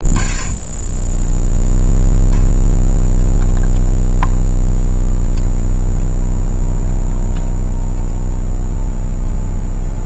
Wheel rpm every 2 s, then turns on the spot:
50, 20, 10, 20, 30.
0-10